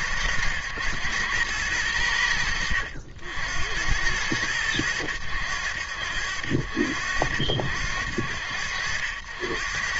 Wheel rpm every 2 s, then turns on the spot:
100, 70, 100, 70, 70.
none